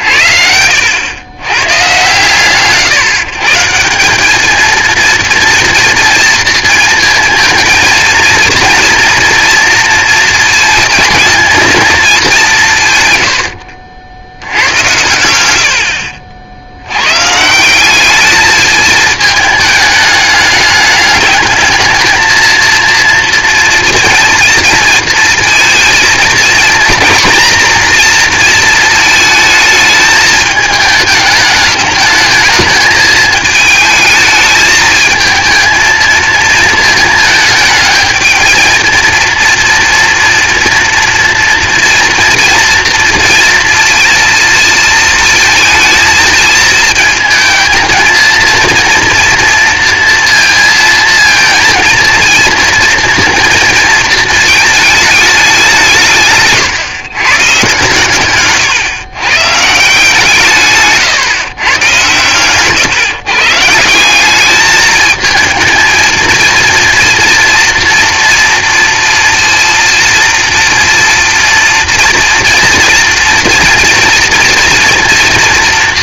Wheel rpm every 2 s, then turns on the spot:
80, 130, 220, 230, 230, 220, 170, 90, 80, 210, 210, 230, 230, 230, 230, 220, 220, 220, 220, 220, 230, 230, 230, 220, 230, 230, 230, 220, 140, 130, 150, 130, 210, 230, 230, 230, 230, 240.
none